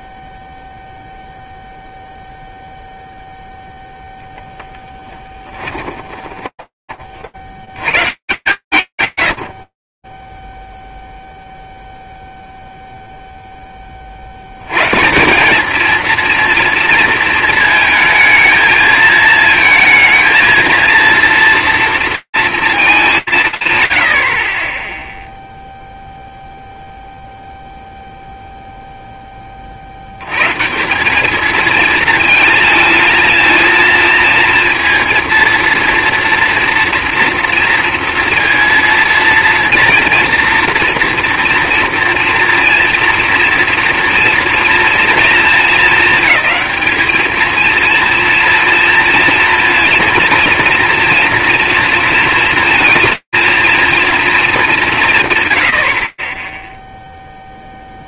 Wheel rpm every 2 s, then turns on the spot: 0, 0, 10, 20, 110, 0, 0, 140, 230, 220, 230, 210, 10, 0, 0, 190, 230, 230, 230, 230, 230, 230, 230, 220, 230, 230, 230, 160, 0.
6-8